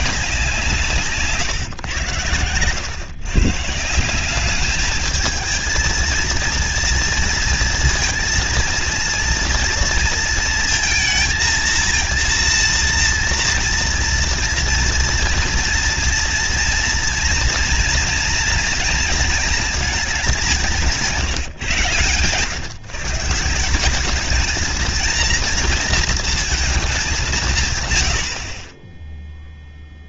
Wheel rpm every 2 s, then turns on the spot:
150, 120, 210, 230, 230, 220, 230, 240, 230, 230, 160, 140, 230, 210, 30.
none